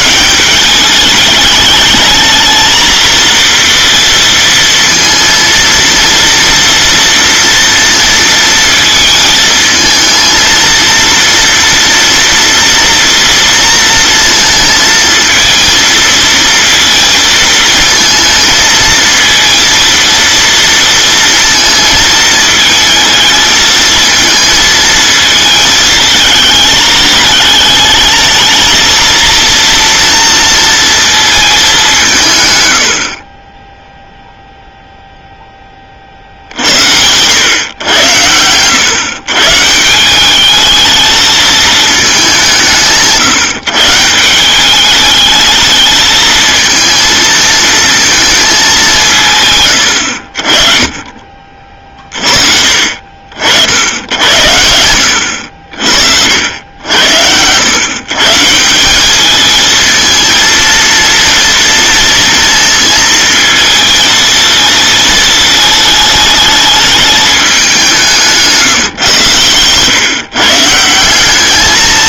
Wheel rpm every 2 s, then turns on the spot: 200, 230, 230, 230, 220, 230, 230, 230, 230, 230, 230, 220, 220, 210, 230, 230, 90, 0, 80, 110, 210, 170, 190, 230, 210, 40, 40, 80, 80, 170, 230, 220, 220, 210, 150, 160.
none